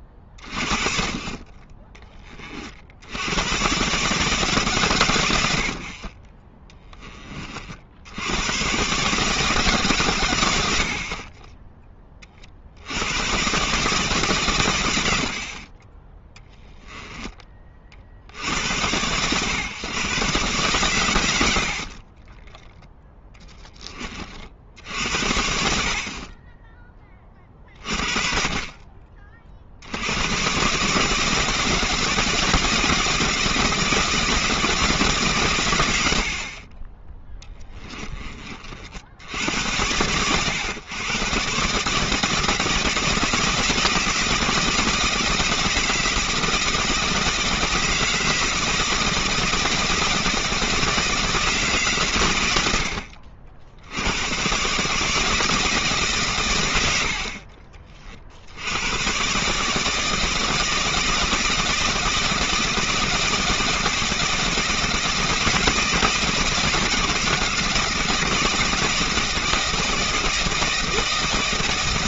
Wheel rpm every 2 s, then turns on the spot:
40, 60, 130, 20, 130, 50, 70, 90, 20, 90, 110, 10, 80, 20, 40, 140, 160, 160, 20, 30, 110, 160, 160, 170, 160, 160, 80, 140, 90, 100, 160, 160, 160, 170, 160, 170.
16-18 22-24